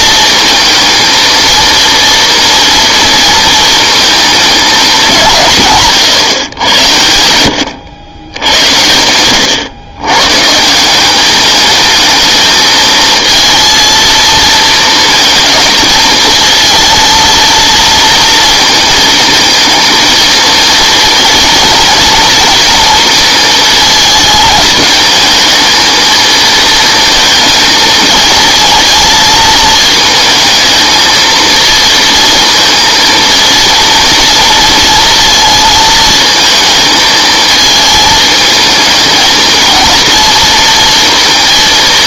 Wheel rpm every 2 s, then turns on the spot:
220, 230, 220, 120, 90, 150, 220, 230, 220, 220, 220, 230, 220, 220, 230, 220, 230, 230, 220, 220, 230.
none